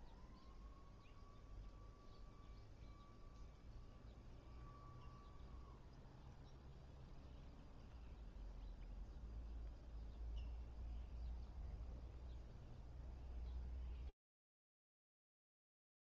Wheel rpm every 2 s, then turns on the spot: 0, 0, 0, 0, 0, 0, 0, 0.
none